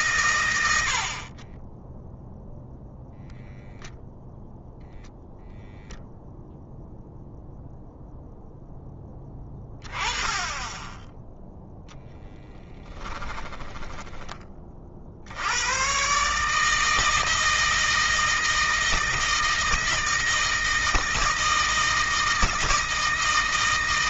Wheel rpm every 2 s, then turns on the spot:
110, 0, 0, 0, 10, 10, 10, 30, 150, 160, 160, 160.
12-14